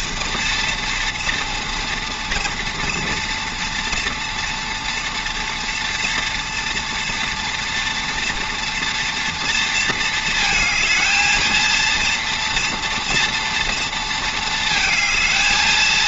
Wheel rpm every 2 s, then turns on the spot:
230, 230, 240, 240, 230, 220, 240, 220.
none